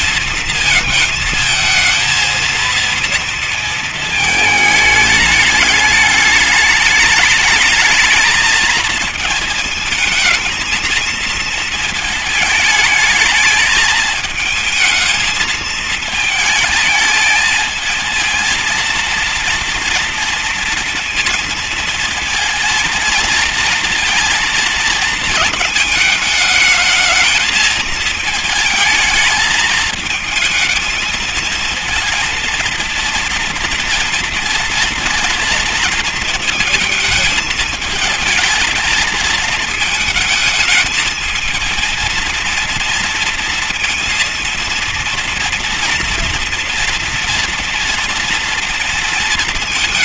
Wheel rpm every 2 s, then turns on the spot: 220, 230, 220, 200, 220, 230, 220, 220, 220, 230, 230, 220, 230, 220, 220, 220, 230, 230, 220, 220, 220, 230, 230, 230, 230.
none